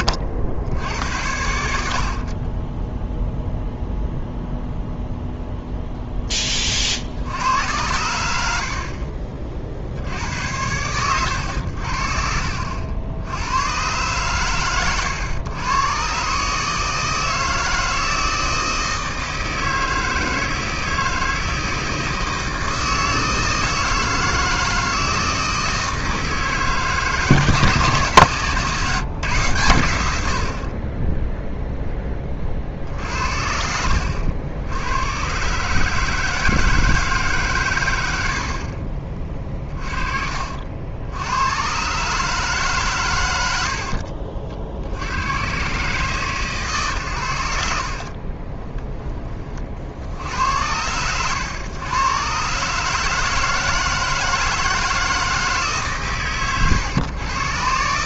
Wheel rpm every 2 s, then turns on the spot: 80, 10, 0, 50, 50, 100, 70, 120, 160, 160, 160, 160, 160, 150, 140, 20, 60, 100, 150, 30, 70, 130, 70, 120, 20, 90, 150, 160, 120.
48-50